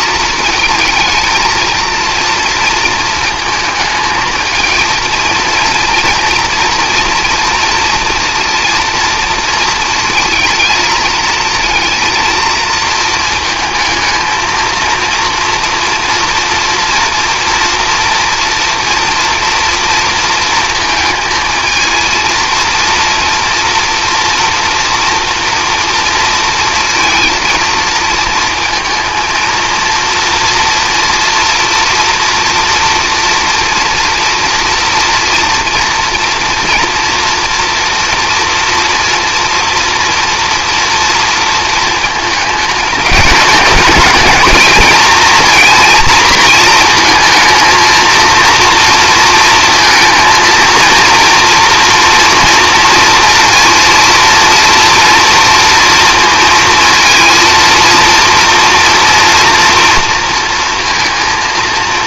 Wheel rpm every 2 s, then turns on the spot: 230, 230, 220, 230, 230, 230, 230, 230, 230, 230, 230, 230, 230, 230, 220, 230, 230, 230, 240, 240, 230, 220, 220, 230, 230, 230, 230, 230, 230, 230, 230.
none